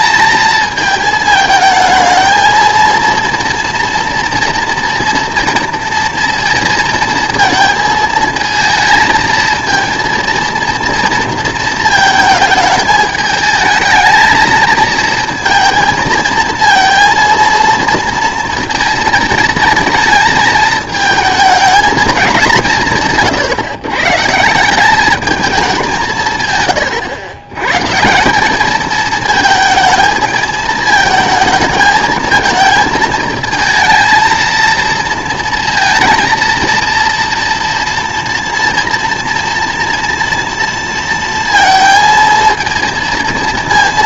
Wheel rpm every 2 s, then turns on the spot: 220, 230, 230, 230, 230, 230, 220, 220, 230, 230, 220, 180, 170, 120, 200, 220, 220, 230, 230, 230, 230, 230.
none